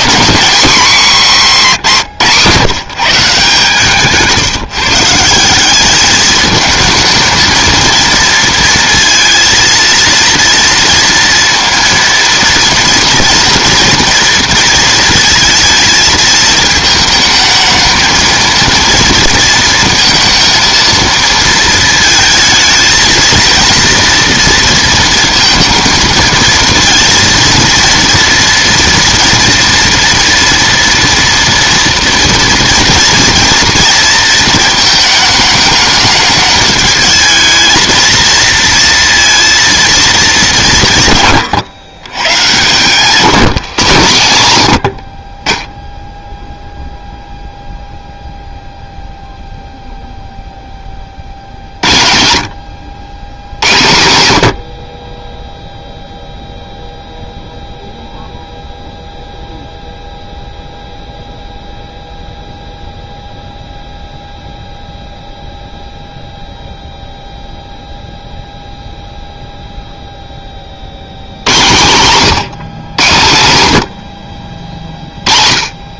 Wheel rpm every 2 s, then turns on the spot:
230, 150, 140, 220, 230, 230, 230, 230, 220, 230, 230, 220, 230, 230, 230, 230, 240, 220, 210, 230, 170, 120, 120, 0, 0, 10, 80, 70, 0, 0, 0, 0, 0, 0, 0, 60, 140, 50.
none